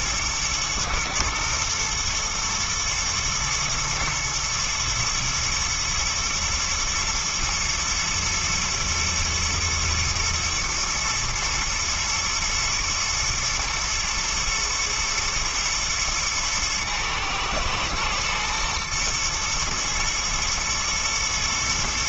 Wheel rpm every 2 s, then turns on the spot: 110, 120, 120, 120, 120, 110, 110, 120, 110, 110, 110.
none